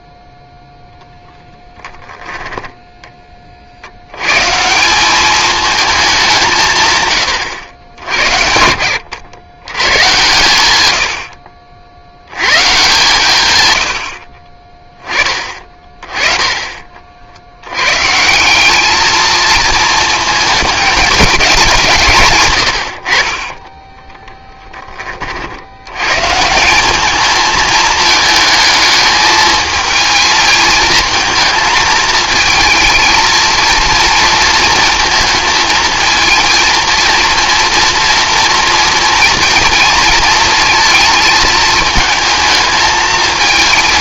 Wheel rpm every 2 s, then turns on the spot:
0, 10, 170, 140, 80, 100, 140, 20, 50, 220, 200, 50, 60, 220, 220, 220, 230, 230, 240, 230, 220, 220.
2-4